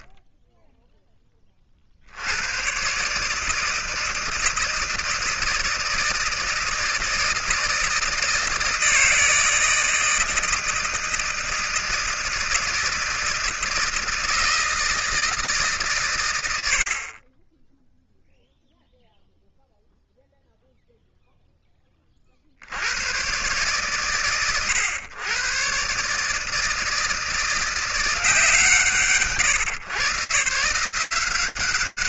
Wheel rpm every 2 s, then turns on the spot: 10, 100, 160, 160, 160, 160, 160, 160, 120, 0, 0, 90, 120, 160, 140, 160.
none